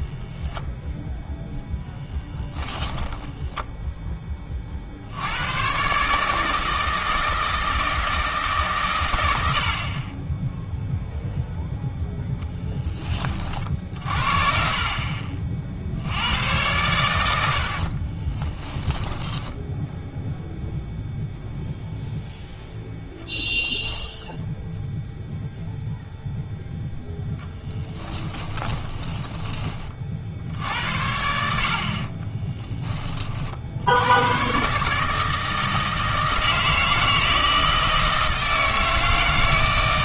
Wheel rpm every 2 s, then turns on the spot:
0, 10, 50, 160, 140, 0, 10, 40, 100, 10, 0, 0, 0, 0, 10, 70, 20, 140, 160, 160.
18-20 28-30